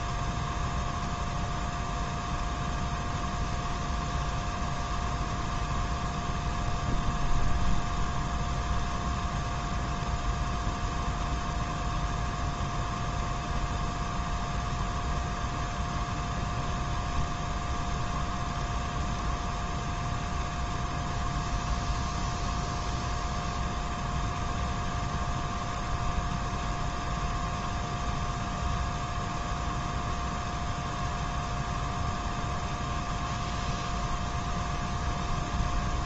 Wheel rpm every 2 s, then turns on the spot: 0, 0, 0, 0, 0, 0, 0, 0, 0, 0, 0, 0, 0, 0, 0, 0, 0, 0.
none